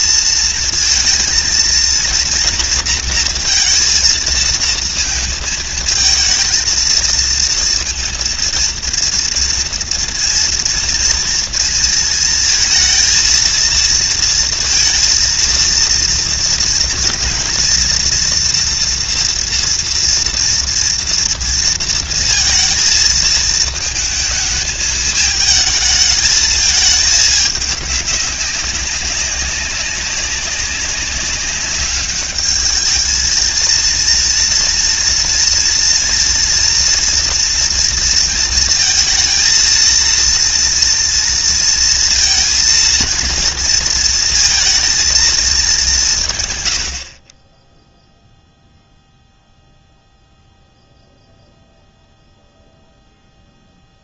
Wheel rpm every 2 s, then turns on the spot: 230, 230, 220, 230, 230, 230, 230, 230, 230, 230, 230, 230, 220, 220, 190, 190, 220, 230, 230, 230, 230, 230, 220, 70, 0, 0, 0.
none